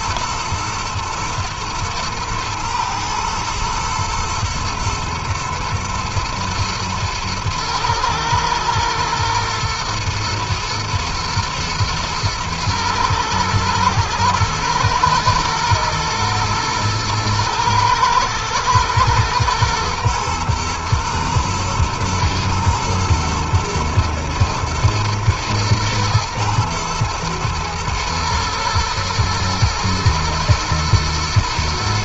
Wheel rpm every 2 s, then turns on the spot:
120, 110, 120, 110, 120, 110, 120, 110, 110, 110, 120, 120, 110, 110, 120, 120.
none